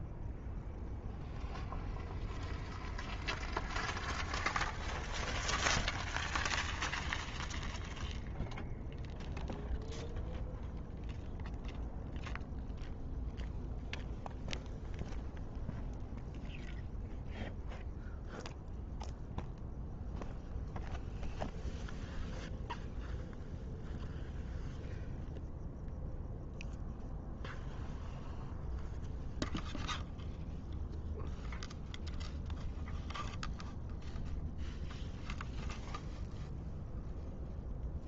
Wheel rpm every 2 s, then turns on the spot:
0, 0, 0, 0, 0, 0, 0, 0, 0, 0, 0, 0, 0, 0, 0, 0, 0, 0, 0.
none